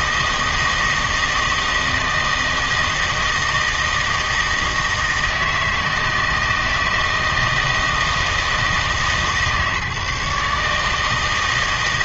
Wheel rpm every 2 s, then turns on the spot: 160, 160, 160, 160, 160, 150.
none